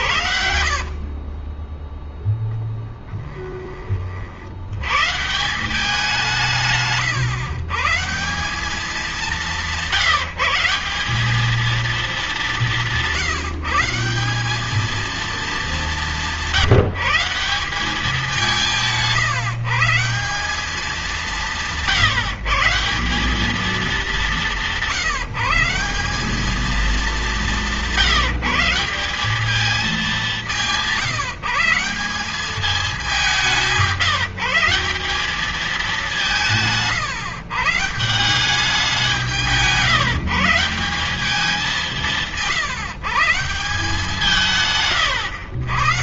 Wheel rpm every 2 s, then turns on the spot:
30, 10, 110, 140, 200, 170, 170, 220, 180, 170, 180, 160, 170, 210, 180, 170, 200, 180, 150, 180, 180, 150, 120.
0-4